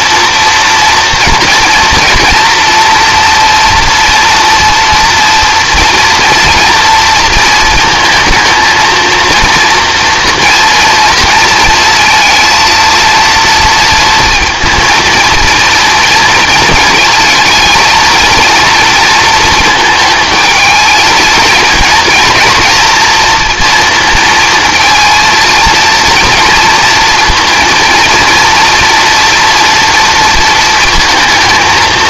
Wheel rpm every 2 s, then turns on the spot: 230, 230, 230, 230, 230, 230, 230, 230, 230, 230, 220, 230, 230, 230, 230, 230.
none